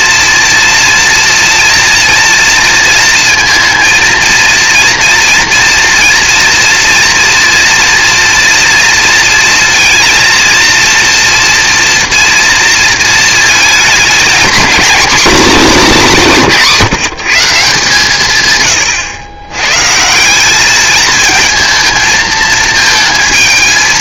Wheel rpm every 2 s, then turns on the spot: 230, 230, 230, 230, 230, 230, 230, 240, 170, 130, 210, 220.
none